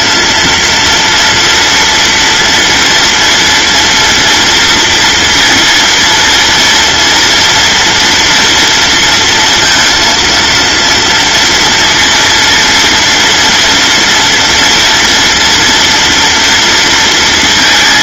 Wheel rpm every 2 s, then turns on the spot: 230, 230, 230, 230, 230, 230, 230, 240, 230.
none